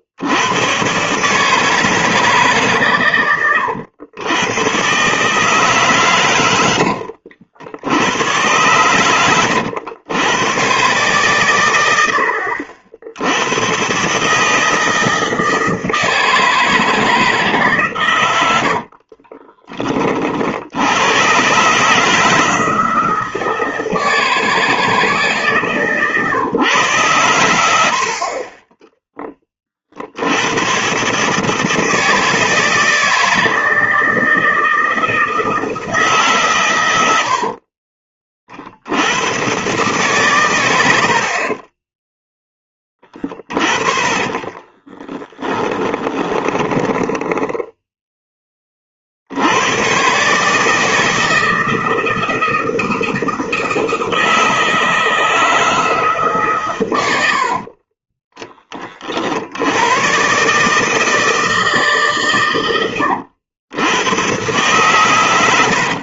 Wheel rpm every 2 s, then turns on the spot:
110, 140, 130, 80, 110, 130, 70, 160, 160, 80, 80, 160, 160, 120, 20, 130, 160, 160, 110, 70, 100, 10, 20, 10, 40, 160, 160, 160, 130, 30, 150, 110, 130.
18-20 44-48